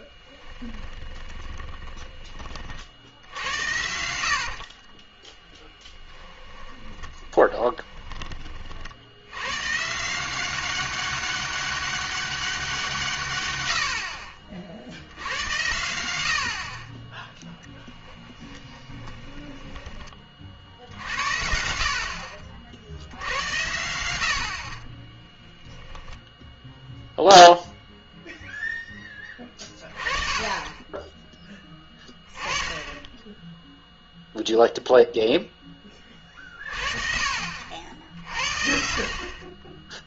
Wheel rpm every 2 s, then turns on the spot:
20, 50, 50, 40, 50, 190, 170, 60, 50, 10, 60, 60, 40, 0, 10, 10, 20, 0, 40, 50.
0-2 4-8 18-20